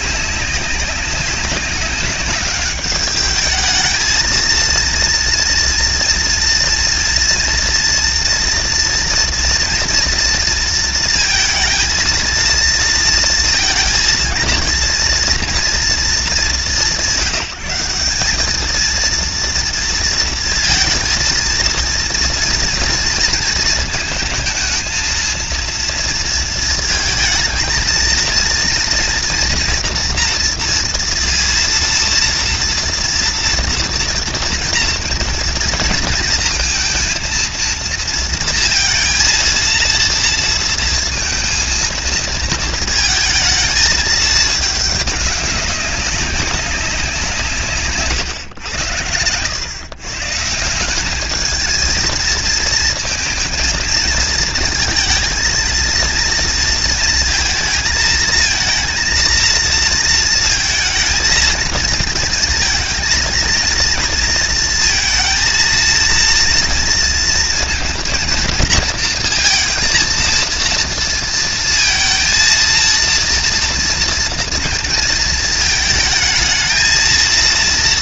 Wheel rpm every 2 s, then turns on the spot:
200, 210, 230, 230, 230, 230, 230, 230, 190, 220, 230, 230, 220, 220, 240, 230, 230, 230, 230, 230, 230, 230, 210, 190, 120, 180, 220, 230, 230, 230, 230, 230, 230, 230, 230, 230, 230, 230, 230.
none